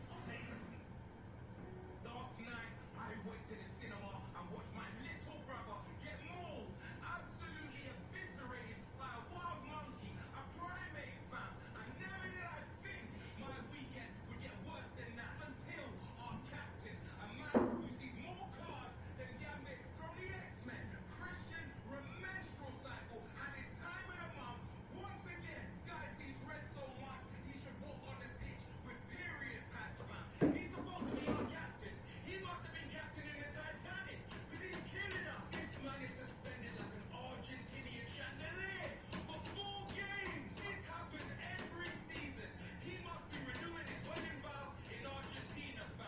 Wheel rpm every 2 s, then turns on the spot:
0, 0, 0, 0, 0, 0, 0, 0, 0, 0, 0, 0, 0, 0, 0, 0, 0, 0, 0, 0, 0, 0, 0.
none